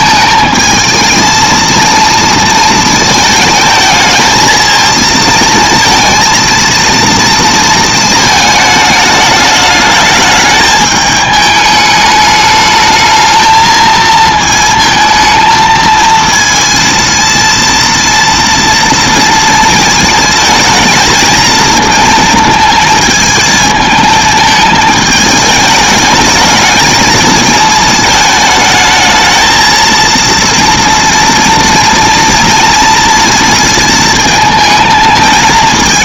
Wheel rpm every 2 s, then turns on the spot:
220, 220, 220, 230, 220, 210, 220, 220, 230, 230, 220, 220, 220, 220, 220, 230, 230, 220.
none